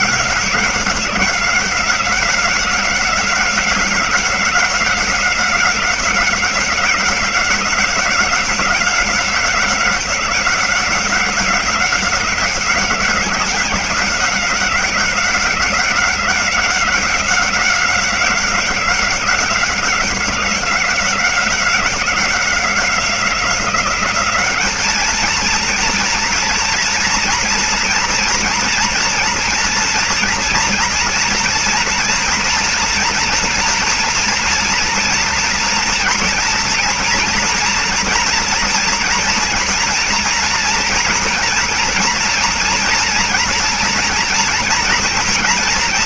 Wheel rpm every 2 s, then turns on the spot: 190, 190, 190, 190, 190, 190, 190, 190, 190, 190, 190, 180, 190, 230, 230, 230, 230, 240, 240, 230, 230, 230, 240.
none